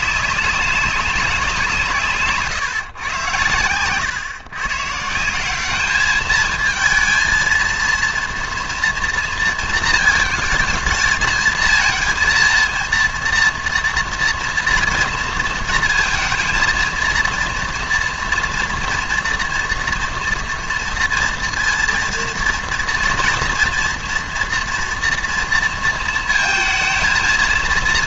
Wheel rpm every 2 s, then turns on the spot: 190, 140, 130, 220, 230, 220, 230, 230, 230, 240, 230, 230, 230, 220.
none